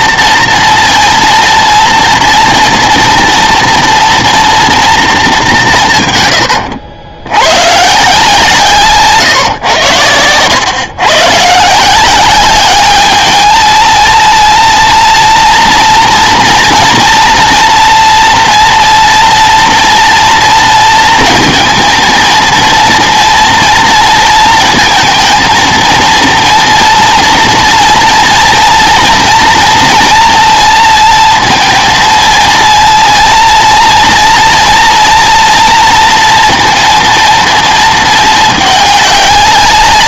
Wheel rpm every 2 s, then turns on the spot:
230, 230, 220, 80, 140, 120, 210, 230, 230, 230, 230, 230, 230, 230, 230, 230, 230, 230, 230, 210.
none